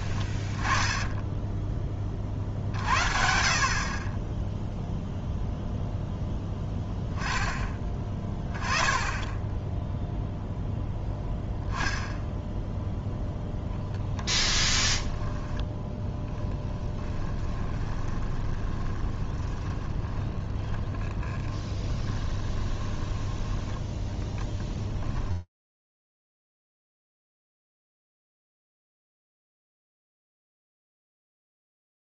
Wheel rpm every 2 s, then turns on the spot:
20, 60, 0, 10, 10, 0, 0, 10, 10, 20, 20, 20, 10, 120, 150, 0.
0-2 14-26